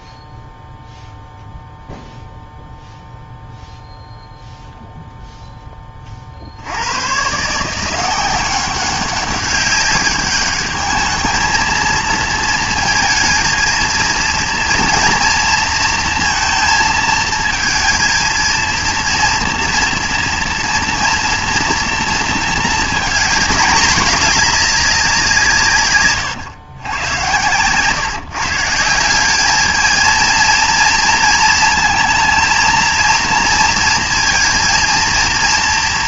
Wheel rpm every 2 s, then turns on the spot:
0, 0, 0, 70, 190, 210, 220, 230, 220, 230, 230, 230, 210, 110, 160, 230, 230, 230.
none